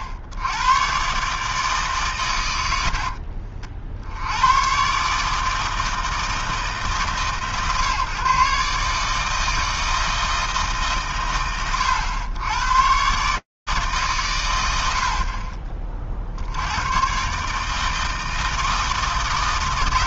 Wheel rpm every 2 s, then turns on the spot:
80, 70, 100, 150, 130, 160, 110, 100, 90, 150.
none